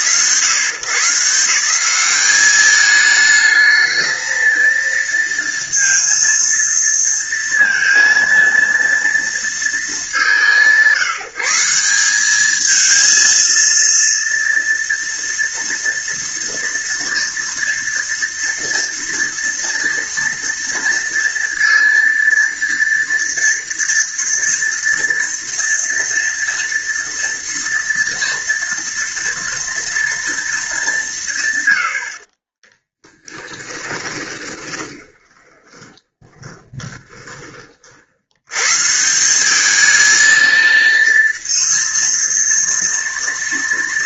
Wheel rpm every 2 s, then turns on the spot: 130, 210, 230, 230, 230, 170, 220, 240, 230, 230, 230, 230, 230, 230, 230, 190, 20, 20, 30, 150, 230, 230.
32-38